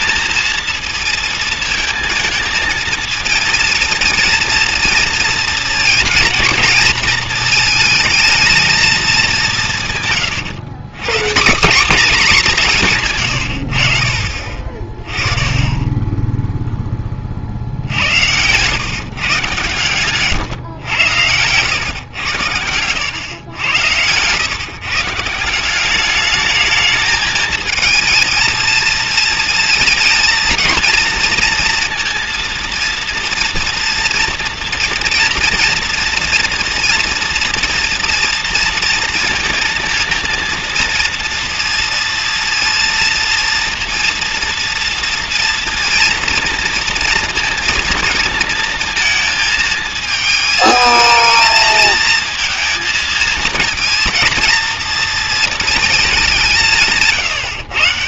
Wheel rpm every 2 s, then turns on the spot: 220, 220, 230, 230, 220, 120, 210, 40, 0, 110, 130, 100, 130, 210, 220, 230, 230, 230, 230, 230, 230, 230, 230, 230, 230, 220, 220, 230, 170.
20-22